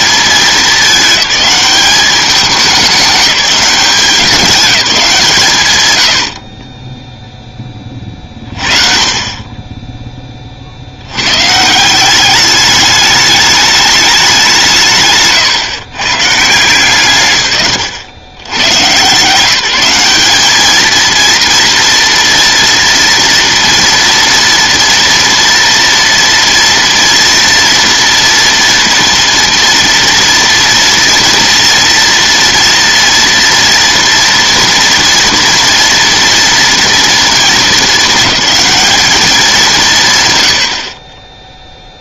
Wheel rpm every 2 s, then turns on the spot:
210, 200, 180, 20, 40, 50, 210, 170, 150, 110, 220, 230, 230, 230, 230, 230, 230, 230, 230, 210, 80.
none